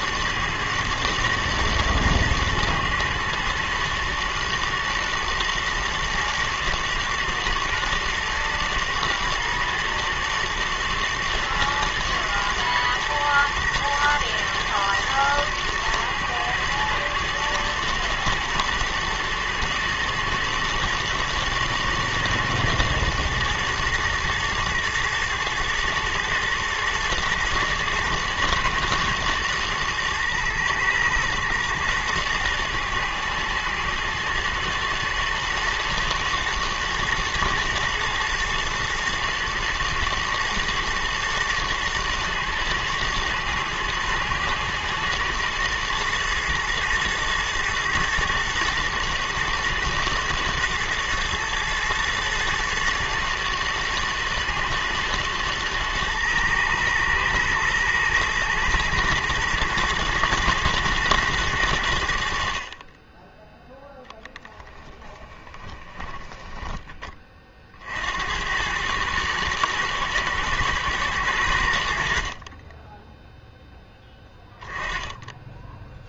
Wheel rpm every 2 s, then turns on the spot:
110, 120, 120, 120, 110, 120, 120, 110, 110, 110, 110, 110, 110, 110, 110, 110, 120, 110, 110, 120, 110, 110, 120, 120, 110, 110, 110, 110, 120, 110, 110, 20, 20, 20, 110, 110, 10, 10.
64-66 72-74